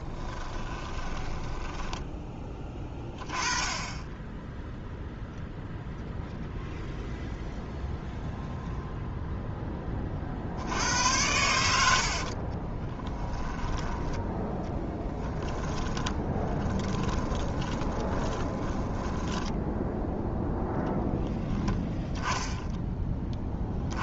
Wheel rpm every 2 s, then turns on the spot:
20, 10, 0, 0, 0, 70, 20, 10, 20, 10, 10, 10.
0-2 12-20